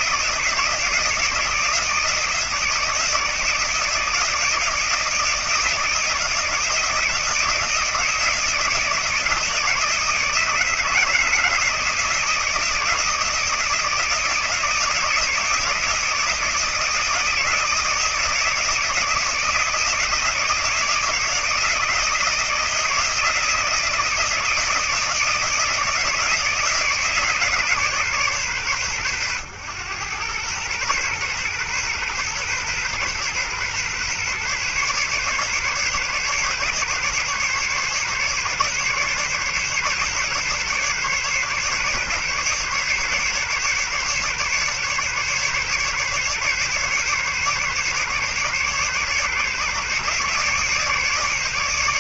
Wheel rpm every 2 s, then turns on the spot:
160, 160, 160, 160, 160, 160, 170, 160, 160, 160, 160, 160, 160, 160, 140, 110, 120, 130, 140, 140, 140, 140, 140, 140, 140, 140.
none